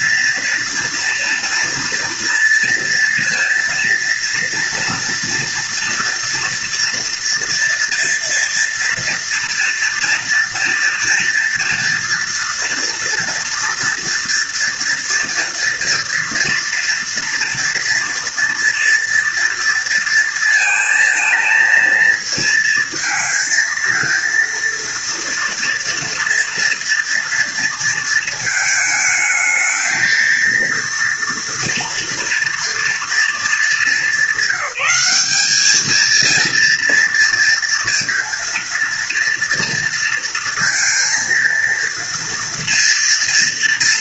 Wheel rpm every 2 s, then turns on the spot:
230, 230, 230, 230, 230, 230, 230, 230, 230, 230, 230, 230, 230, 230, 220, 230, 230, 200, 230, 230, 230, 230.
none